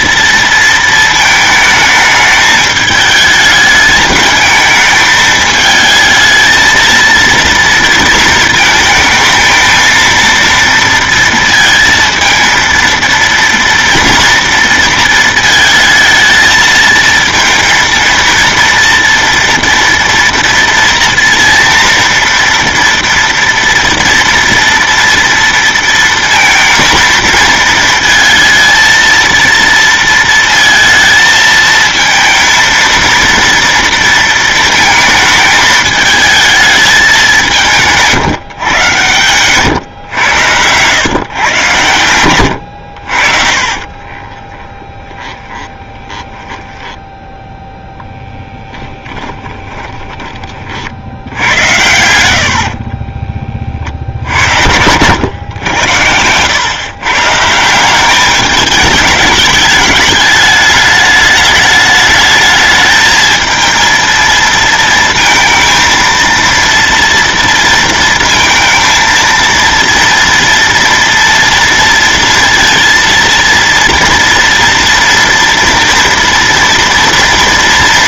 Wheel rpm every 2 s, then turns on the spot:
230, 220, 220, 230, 230, 230, 230, 240, 220, 230, 230, 230, 230, 230, 230, 230, 230, 230, 220, 150, 110, 80, 20, 10, 10, 30, 80, 80, 110, 200, 210, 220, 220, 230, 230, 230, 230, 230, 230.
44-50 52-54